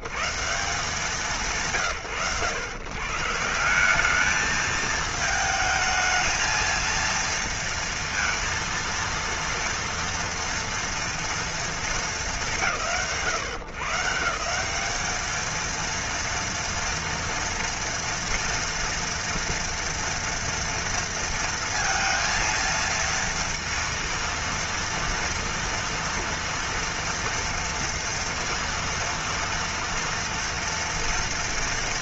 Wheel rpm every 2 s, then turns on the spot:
110, 90, 210, 230, 230, 230, 170, 170, 230, 230, 230, 230, 230, 230, 230, 230.
none